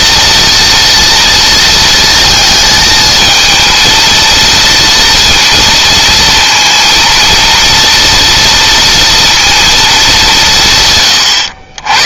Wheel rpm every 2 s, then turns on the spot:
230, 220, 230, 230, 230, 110.
10-12